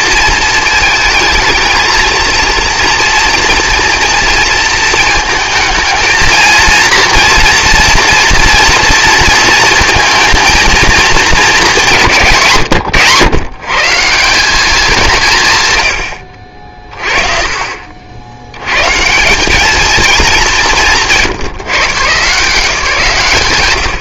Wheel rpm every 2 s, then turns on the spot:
220, 230, 230, 230, 230, 220, 140, 210, 50, 90, 190, 170.
none